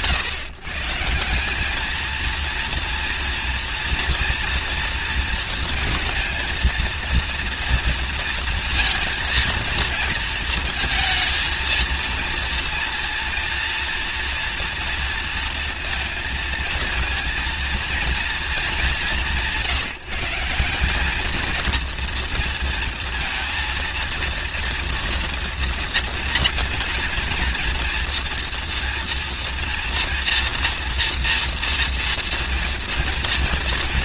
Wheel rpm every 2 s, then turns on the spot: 140, 230, 230, 230, 230, 230, 230, 230, 230, 200, 200, 230, 230, 230, 230, 230, 230.
none